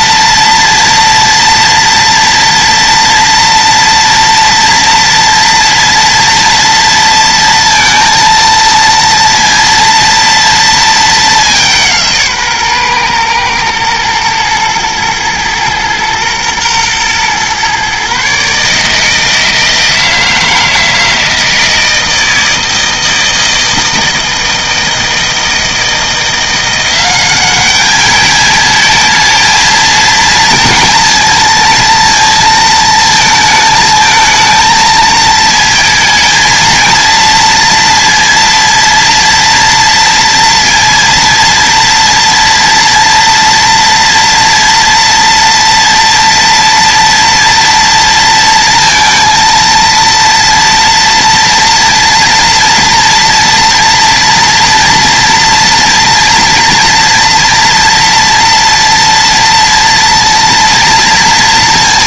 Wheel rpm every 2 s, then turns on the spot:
230, 230, 230, 230, 230, 220, 130, 110, 120, 150, 160, 160, 160, 180, 220, 230, 230, 220, 230, 230, 230, 230, 230, 240, 230, 230, 230, 230, 230, 230, 230.
none